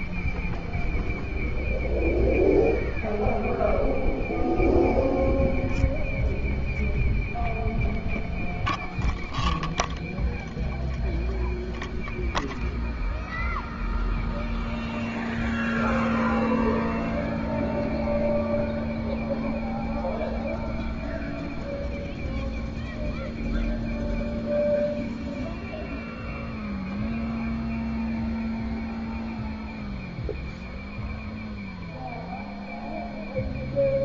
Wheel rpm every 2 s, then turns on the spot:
0, 0, 0, 0, 0, 0, 0, 0, 0, 0, 0, 0, 0, 0, 0, 0, 0.
none